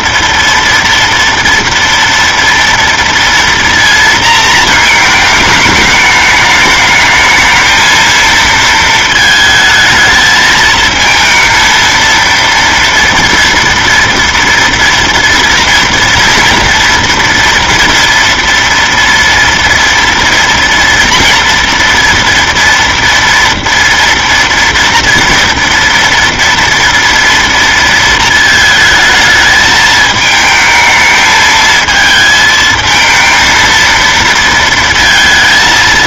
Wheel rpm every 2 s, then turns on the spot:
230, 230, 220, 210, 230, 220, 230, 230, 230, 230, 230, 230, 240, 230, 220, 220, 220, 230.
none